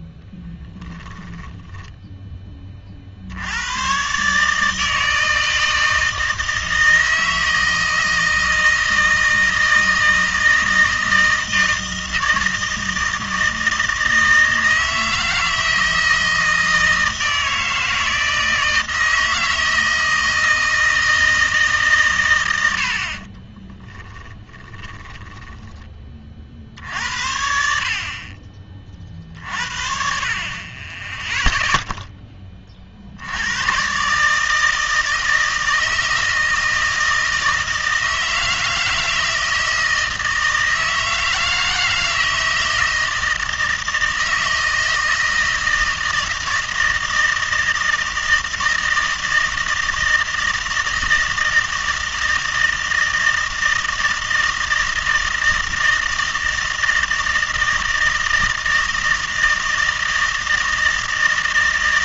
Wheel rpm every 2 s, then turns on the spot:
10, 80, 160, 160, 160, 160, 160, 160, 160, 160, 160, 30, 10, 70, 50, 0, 90, 160, 160, 160, 160, 160, 160, 160, 160, 160, 160, 160, 160, 160, 160.
0-2 22-26